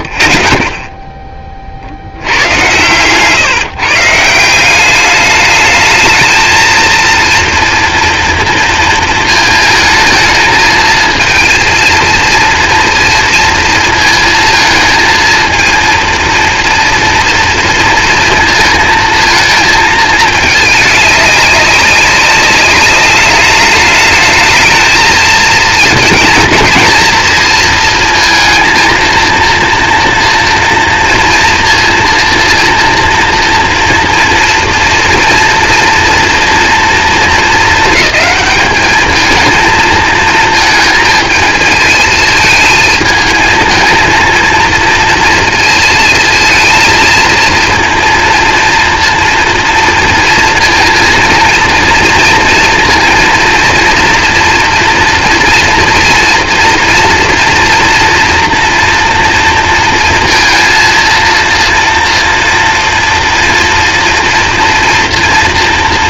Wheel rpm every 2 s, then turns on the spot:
10, 120, 200, 230, 220, 220, 230, 230, 230, 230, 210, 200, 220, 230, 230, 230, 230, 230, 220, 220, 220, 220, 230, 230, 230, 230, 230, 230, 230, 230, 230, 240, 230.
none